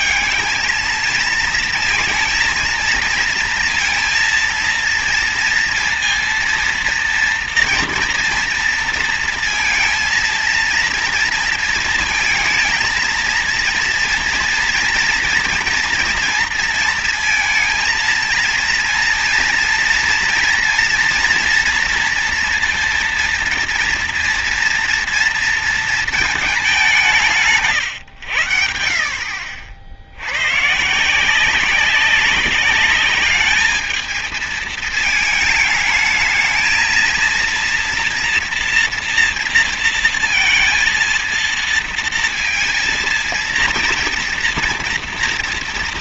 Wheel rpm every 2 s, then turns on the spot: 220, 230, 230, 230, 230, 230, 230, 230, 230, 230, 230, 230, 230, 220, 100, 90, 200, 220, 220, 230, 230, 230, 230.
none